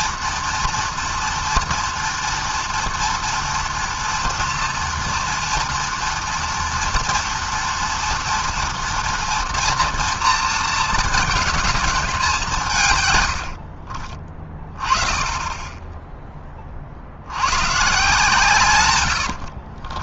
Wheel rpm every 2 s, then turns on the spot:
240, 230, 230, 230, 230, 230, 170, 20, 20, 140.
none